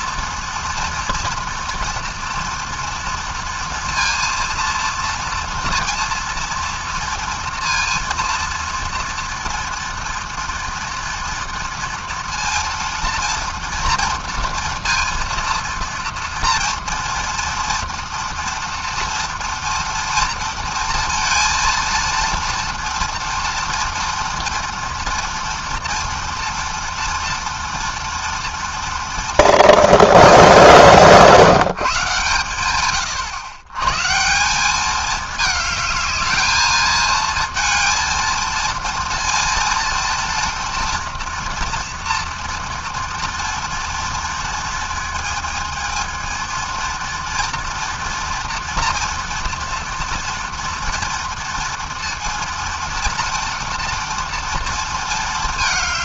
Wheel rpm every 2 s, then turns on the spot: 240, 230, 230, 230, 230, 230, 230, 230, 230, 230, 230, 230, 230, 240, 230, 180, 120, 210, 220, 230, 230, 230, 220, 230, 230, 230, 240, 230.
none